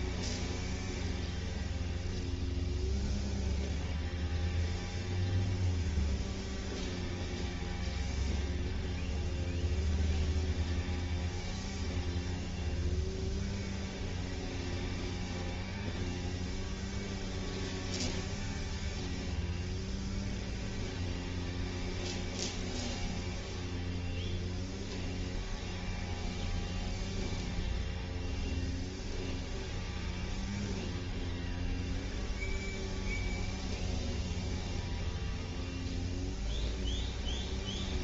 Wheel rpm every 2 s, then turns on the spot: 0, 0, 0, 0, 0, 0, 0, 0, 0, 0, 0, 0, 0, 0, 0, 0, 0, 0, 0.
none